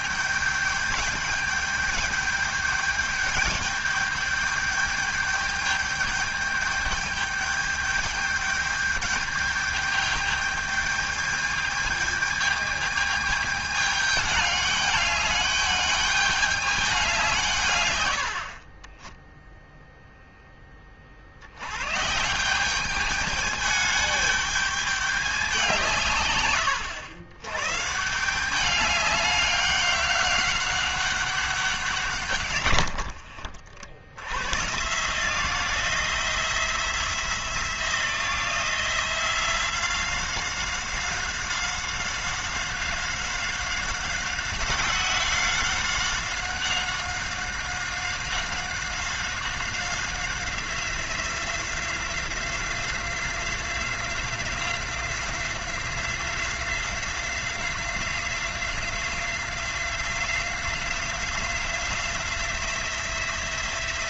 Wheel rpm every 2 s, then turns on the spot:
200, 210, 210, 210, 210, 210, 210, 210, 210, 60, 20, 180, 210, 110, 190, 200, 120, 110, 170, 170, 190, 190, 190, 190, 190, 180, 180, 180, 180, 180, 180, 180.
18-20